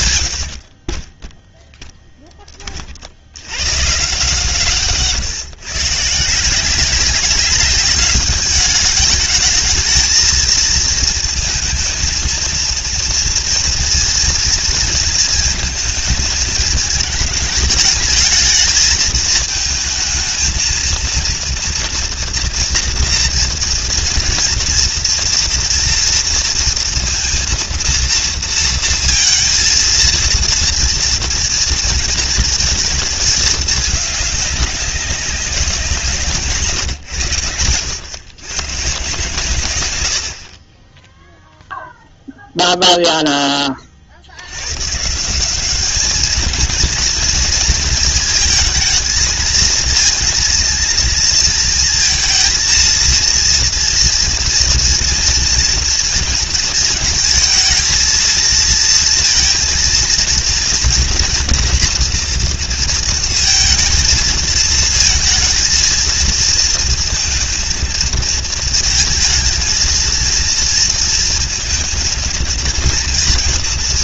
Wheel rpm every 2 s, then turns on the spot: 70, 30, 140, 170, 210, 230, 230, 230, 210, 220, 220, 230, 230, 230, 230, 230, 230, 200, 140, 130, 30, 0, 120, 230, 220, 230, 230, 230, 220, 230, 230, 230, 220, 230, 230, 230, 230.
36-38